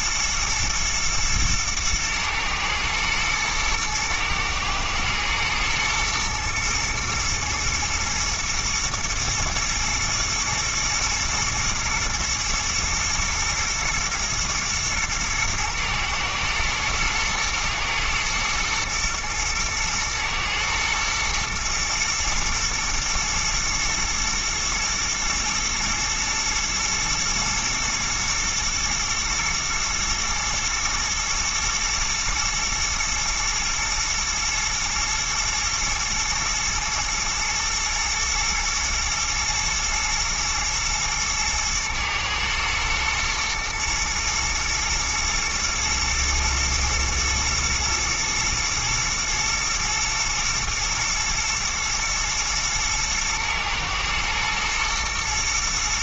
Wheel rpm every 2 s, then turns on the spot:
120, 110, 110, 120, 120, 110, 120, 110, 110, 110, 120, 120, 120, 110, 110, 110, 120, 110, 110, 120, 110, 110, 120, 110, 120, 120, 110, 110.
none